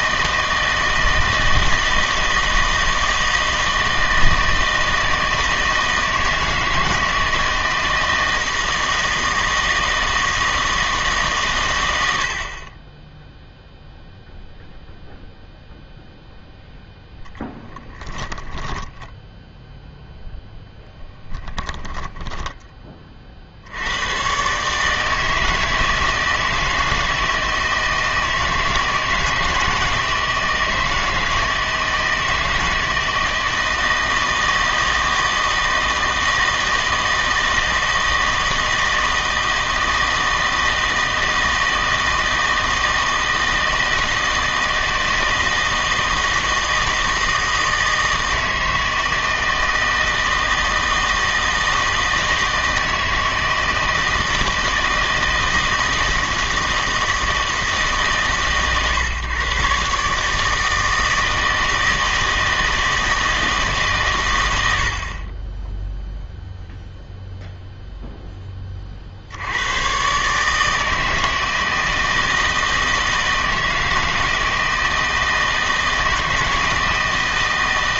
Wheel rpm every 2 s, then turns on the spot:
160, 160, 160, 160, 160, 160, 40, 0, 0, 10, 0, 20, 150, 160, 160, 160, 160, 160, 160, 160, 160, 160, 160, 160, 160, 160, 160, 160, 160, 130, 160, 160, 100, 0, 20, 150, 160, 160, 160.
18-20